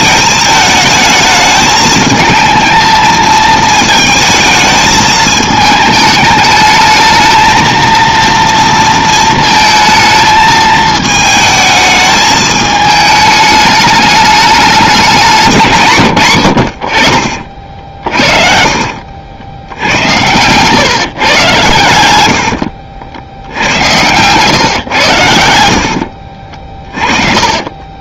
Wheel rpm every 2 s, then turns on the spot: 220, 220, 220, 220, 230, 220, 220, 200, 80, 50, 130, 80, 110, 40.
18-20 22-24 26-28